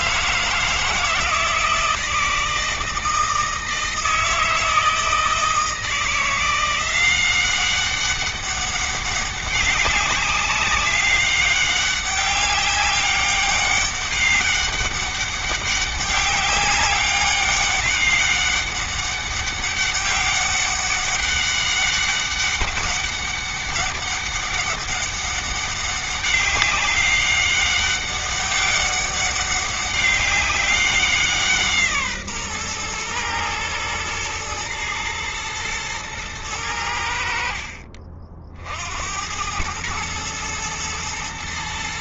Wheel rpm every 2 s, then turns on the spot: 160, 160, 160, 180, 200, 200, 200, 200, 200, 200, 200, 200, 200, 200, 200, 190, 120, 110, 90, 60, 100.
none